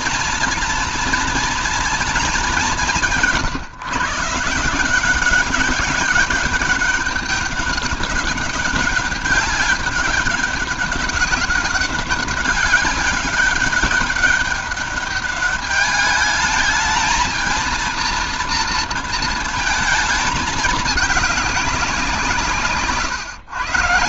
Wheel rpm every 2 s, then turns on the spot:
230, 200, 160, 200, 200, 200, 190, 200, 210, 230, 210, 160.
22-24